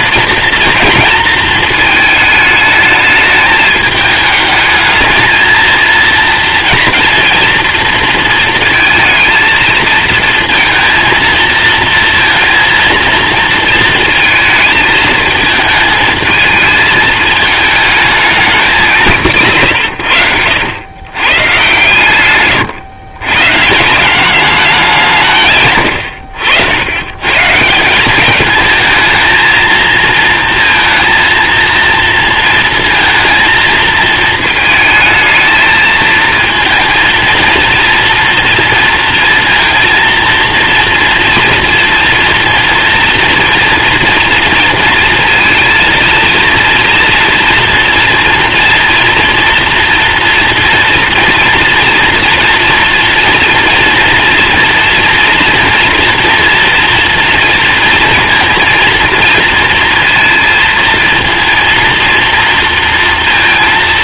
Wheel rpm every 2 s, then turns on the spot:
230, 210, 220, 230, 220, 230, 230, 220, 220, 180, 90, 130, 200, 100, 220, 230, 230, 220, 230, 230, 230, 230, 230, 230, 230, 230, 230, 230, 230, 230, 230, 230.
none